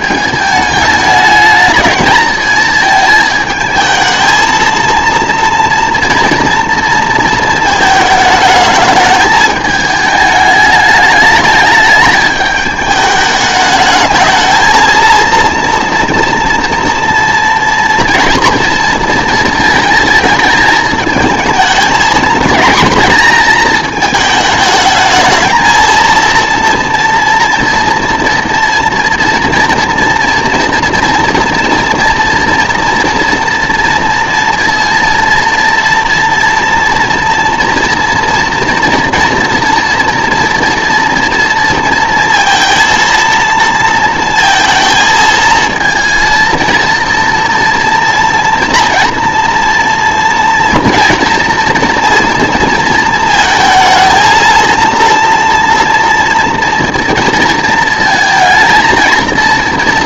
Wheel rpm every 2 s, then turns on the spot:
220, 220, 230, 230, 210, 210, 210, 230, 230, 230, 220, 240, 220, 230, 230, 240, 230, 230, 230, 240, 230, 230, 220, 230, 240, 230, 220, 230, 230, 230.
none